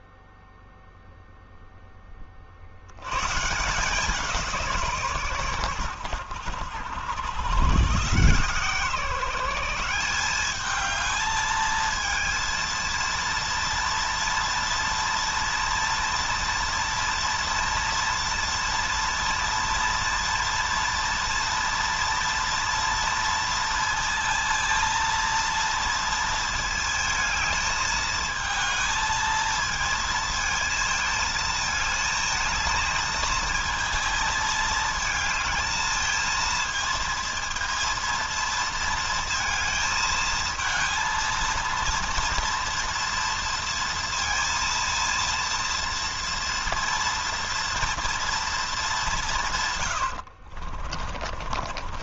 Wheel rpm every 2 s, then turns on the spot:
0, 80, 150, 100, 150, 210, 230, 230, 240, 230, 230, 230, 230, 220, 220, 220, 220, 220, 220, 220, 220, 230, 230, 230, 210, 40.
50-52